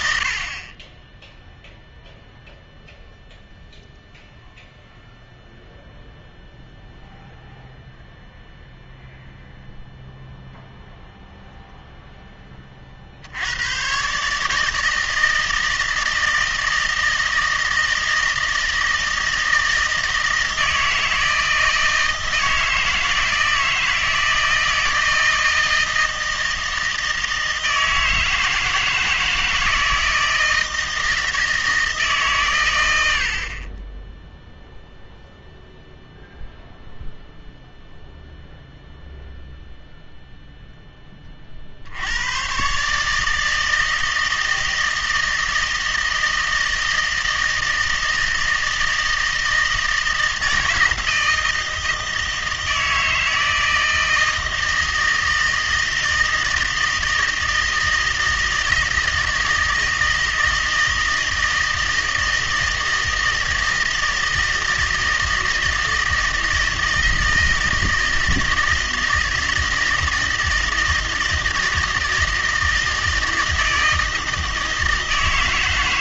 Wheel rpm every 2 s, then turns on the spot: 30, 0, 0, 0, 0, 0, 40, 160, 160, 160, 160, 160, 160, 160, 160, 160, 110, 0, 0, 0, 10, 140, 160, 160, 160, 160, 160, 160, 160, 160, 160, 160, 160, 160, 160, 160, 160, 160.
none